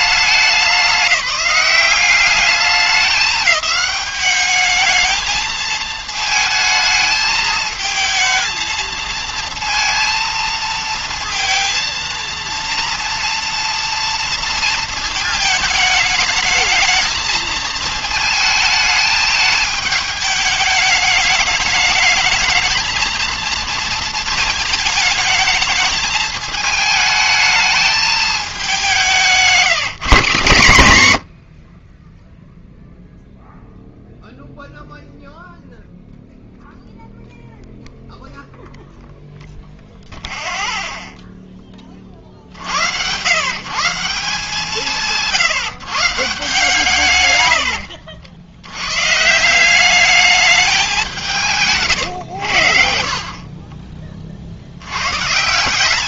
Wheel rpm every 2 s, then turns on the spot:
200, 200, 210, 220, 220, 230, 230, 230, 220, 220, 210, 220, 220, 210, 200, 140, 0, 0, 0, 0, 0, 70, 170, 150, 90, 200, 70, 70.
none